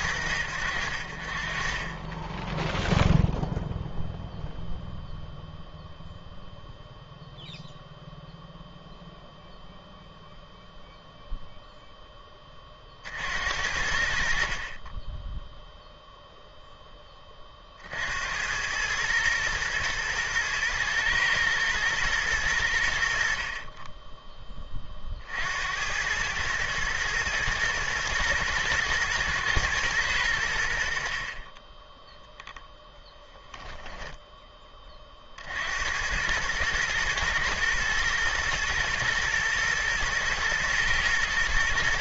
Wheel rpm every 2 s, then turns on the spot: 60, 10, 0, 0, 0, 0, 30, 40, 10, 100, 110, 90, 30, 110, 120, 70, 0, 20, 110, 110, 110.
none